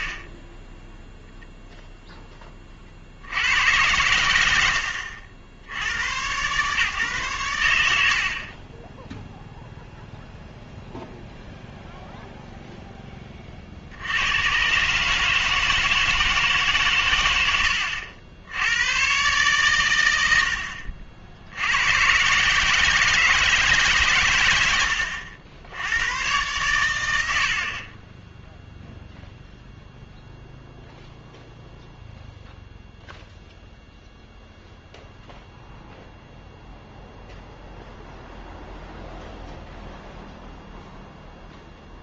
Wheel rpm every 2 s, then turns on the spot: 20, 30, 70, 140, 20, 0, 0, 130, 120, 110, 60, 160, 90, 70, 0, 0, 0, 0, 0, 0, 0.
0-2 20-22 24-26